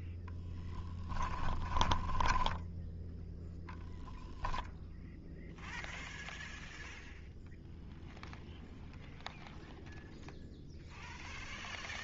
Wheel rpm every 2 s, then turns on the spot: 0, 10, 0, 0, 0, 0.
2-4